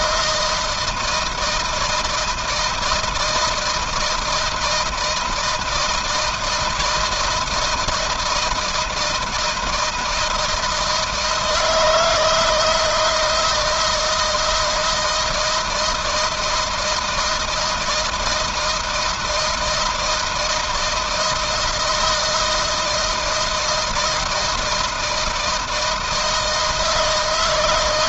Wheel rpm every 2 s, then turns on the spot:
160, 160, 160, 160, 160, 160, 160, 160, 160, 160, 170, 160, 160, 160.
none